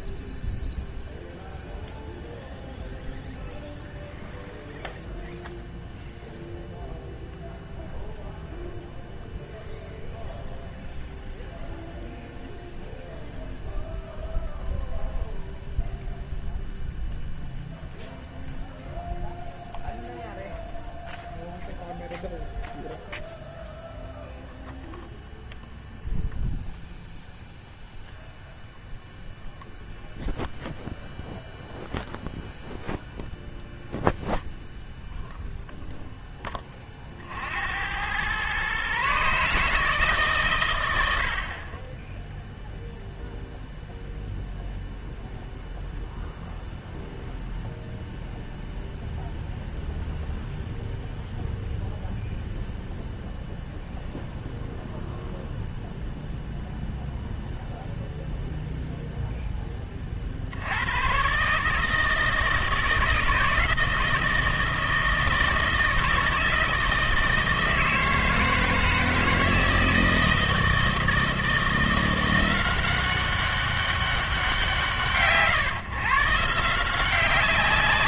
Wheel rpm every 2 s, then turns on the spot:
0, 0, 0, 0, 0, 0, 0, 0, 0, 0, 0, 0, 0, 0, 0, 0, 0, 0, 30, 130, 110, 0, 0, 0, 0, 0, 0, 0, 0, 0, 90, 160, 160, 160, 160, 160, 180, 160, 160.
none